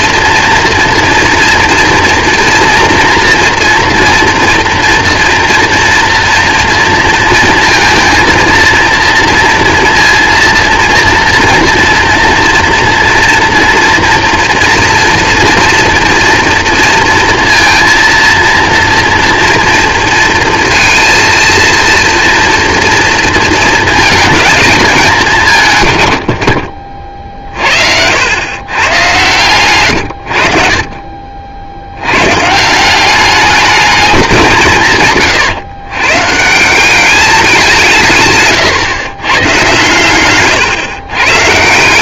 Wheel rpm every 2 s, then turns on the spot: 230, 230, 230, 230, 230, 230, 230, 230, 230, 230, 230, 230, 220, 60, 110, 50, 170, 160, 180, 130, 130.
none